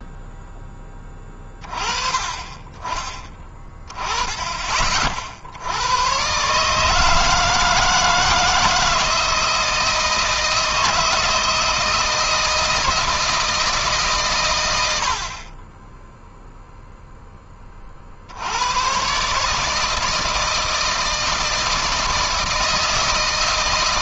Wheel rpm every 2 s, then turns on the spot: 10, 20, 20, 130, 160, 170, 170, 110, 0, 90, 160, 160.
none